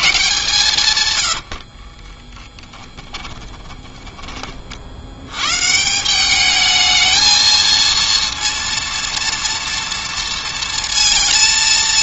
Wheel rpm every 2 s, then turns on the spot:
150, 20, 50, 210, 230, 230.
2-4